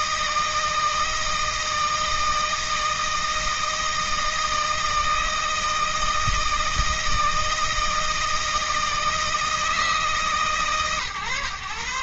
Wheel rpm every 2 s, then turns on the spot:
160, 160, 160, 160, 160, 140.
none